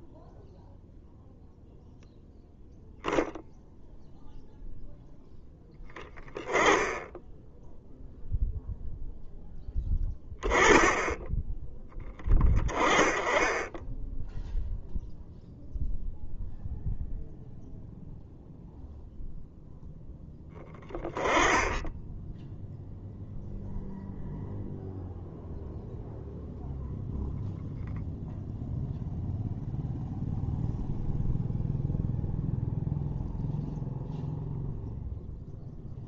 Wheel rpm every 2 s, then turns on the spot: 0, 0, 0, 10, 0, 10, 20, 0, 0, 0, 20, 0, 0, 0, 0, 0, 0, 0.
none